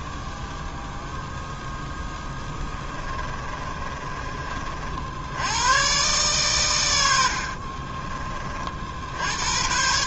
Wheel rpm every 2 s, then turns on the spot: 0, 10, 40, 120, 50.
2-4